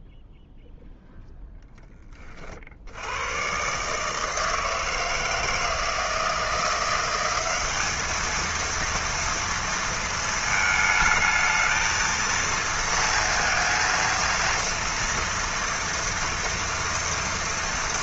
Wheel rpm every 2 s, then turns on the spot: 0, 30, 160, 160, 220, 220, 230, 230, 230.
none